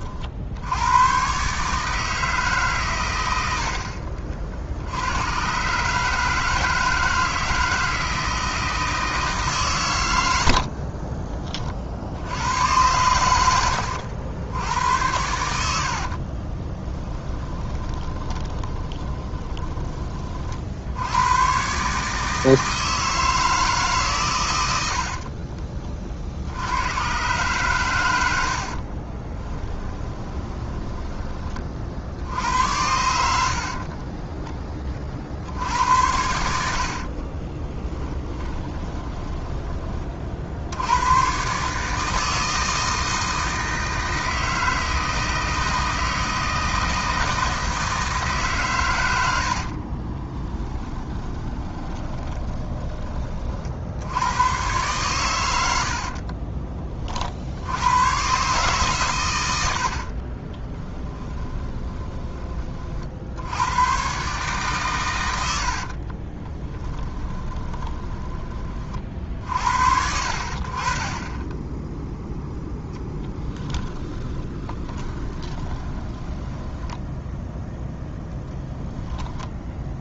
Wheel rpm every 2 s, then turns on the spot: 90, 130, 70, 150, 160, 40, 110, 90, 20, 20, 70, 160, 80, 100, 40, 20, 80, 60, 60, 20, 90, 160, 160, 160, 110, 20, 20, 120, 30, 130, 20, 40, 130, 10, 40, 40, 10, 20, 10, 0.
10-12 16-20 28-32 36-40 50-52 60-62 66-68 74-78